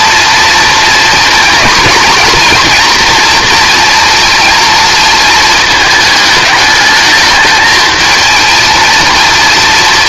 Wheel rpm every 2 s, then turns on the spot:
240, 240, 220, 220, 230.
none